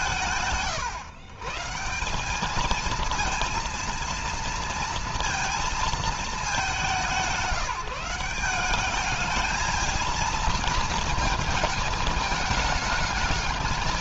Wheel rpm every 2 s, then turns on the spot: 130, 230, 230, 190, 210, 220, 210.
none